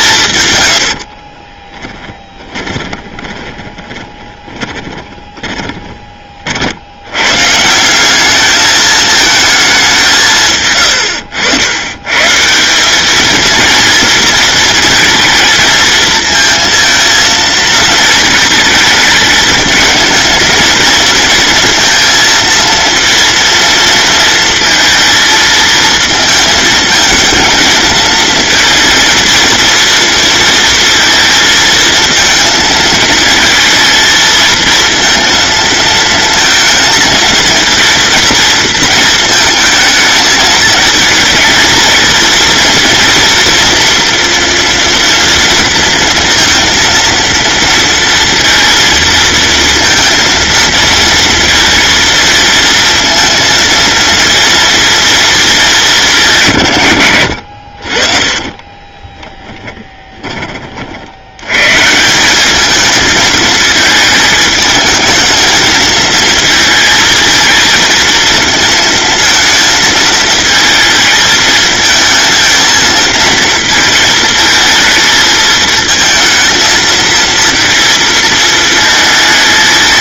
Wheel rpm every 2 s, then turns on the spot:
80, 20, 20, 80, 210, 110, 190, 230, 230, 210, 230, 230, 230, 220, 230, 230, 220, 220, 220, 230, 220, 230, 230, 230, 230, 230, 230, 230, 110, 20, 50, 220, 220, 230, 230, 230, 230, 230, 230, 220.
0-6 58-60